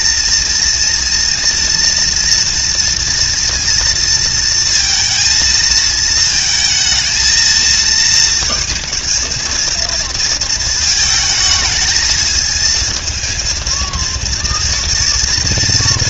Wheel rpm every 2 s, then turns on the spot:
230, 230, 230, 230, 230, 230, 220, 240.
none